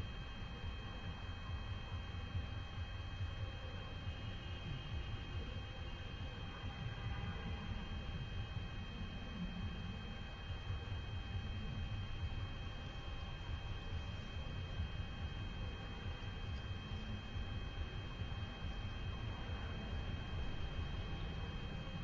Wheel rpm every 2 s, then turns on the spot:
0, 0, 0, 0, 0, 0, 0, 0, 0, 0, 0.
none